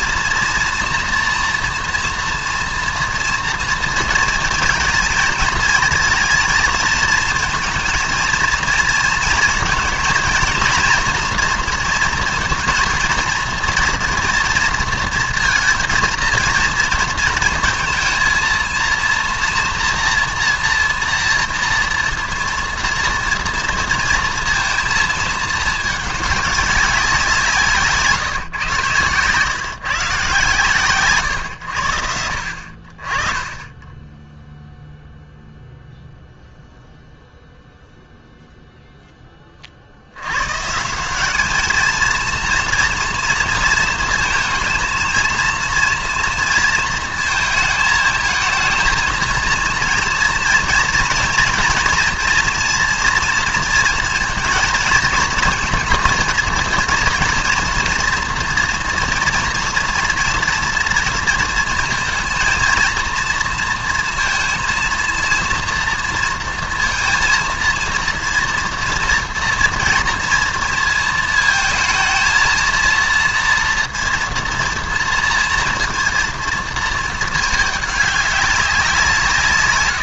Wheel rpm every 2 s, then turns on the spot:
240, 230, 230, 220, 230, 230, 230, 230, 230, 230, 240, 230, 230, 200, 130, 130, 50, 0, 0, 0, 150, 240, 220, 230, 220, 230, 230, 230, 230, 230, 230, 230, 230, 230, 230, 230, 230, 230, 230, 190.
none